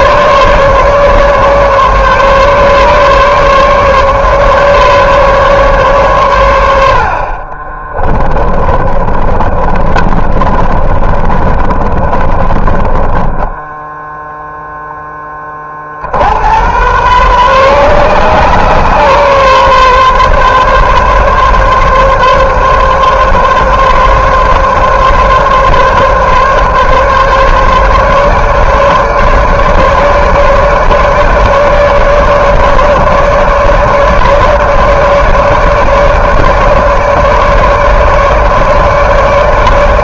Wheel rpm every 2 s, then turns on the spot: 140, 140, 140, 100, 20, 30, 20, 0, 90, 130, 140, 140, 140, 140, 150, 150, 150, 150, 150, 150.
8-14